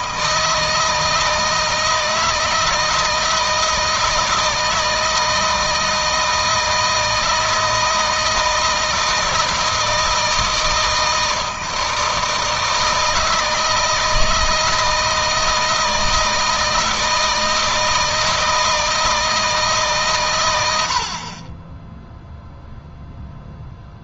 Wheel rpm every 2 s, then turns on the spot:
160, 160, 160, 160, 160, 160, 160, 160, 160, 160, 80, 0.
none